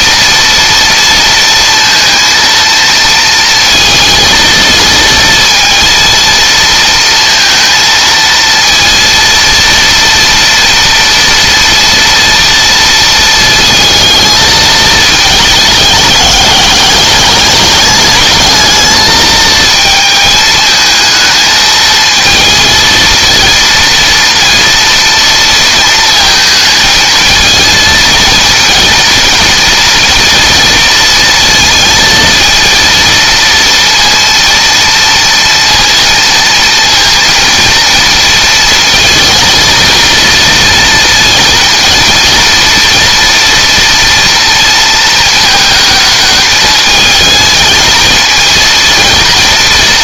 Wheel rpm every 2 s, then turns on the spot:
230, 230, 230, 230, 230, 230, 230, 220, 200, 220, 220, 230, 230, 220, 230, 230, 230, 230, 230, 230, 230, 230, 230, 220, 230.
none